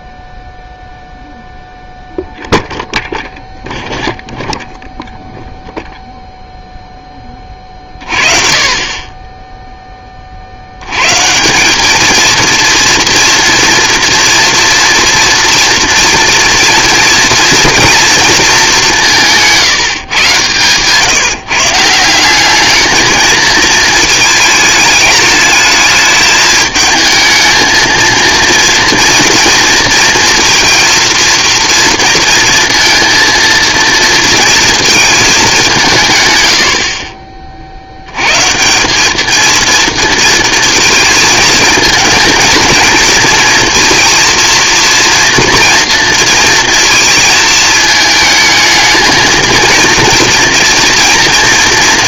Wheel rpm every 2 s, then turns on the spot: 0, 0, 0, 0, 40, 80, 230, 230, 230, 200, 140, 220, 220, 220, 240, 230, 230, 230, 90, 170, 230, 220, 230, 230, 220, 240.
none